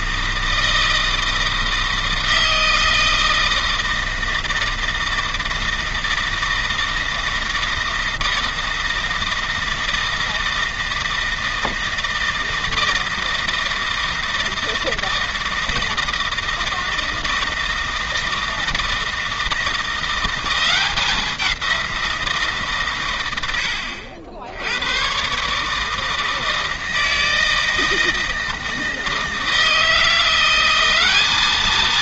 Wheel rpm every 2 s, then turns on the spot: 160, 160, 160, 160, 160, 160, 160, 160, 160, 160, 180, 140, 90, 160, 160, 190.
none